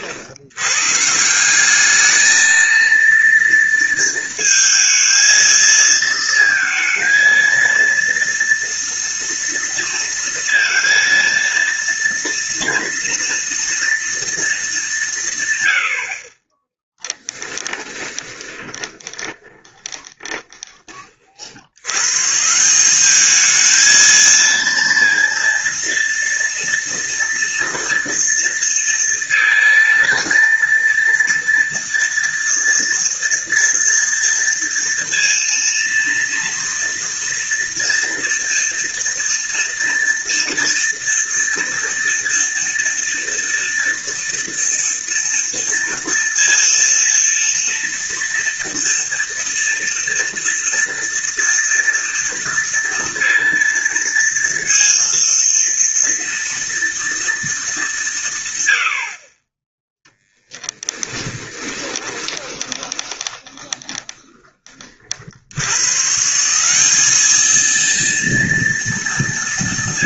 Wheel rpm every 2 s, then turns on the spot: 150, 230, 230, 230, 230, 230, 230, 190, 10, 20, 30, 180, 230, 240, 230, 230, 230, 230, 230, 230, 230, 230, 230, 230, 230, 230, 230, 230, 230, 80, 10, 20, 40, 200, 230.
16-20 60-64